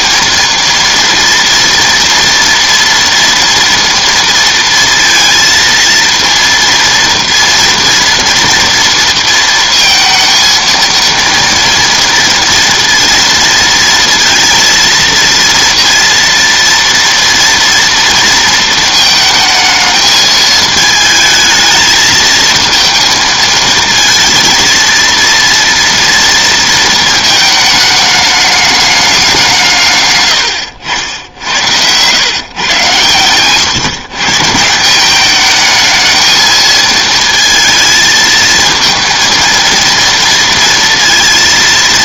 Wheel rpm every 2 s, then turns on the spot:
230, 230, 230, 230, 230, 230, 230, 230, 230, 220, 220, 220, 230, 230, 210, 80, 120, 190, 220, 230, 230.
none